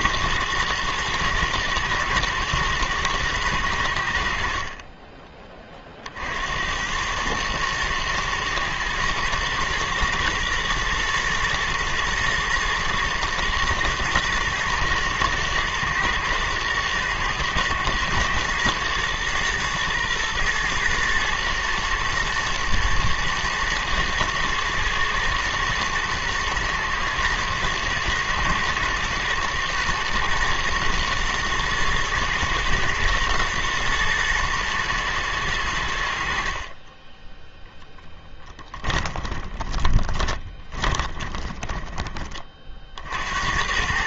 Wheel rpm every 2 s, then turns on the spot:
110, 110, 30, 110, 110, 110, 110, 110, 110, 120, 120, 110, 120, 120, 120, 120, 120, 110, 10, 20, 20, 70.
38-42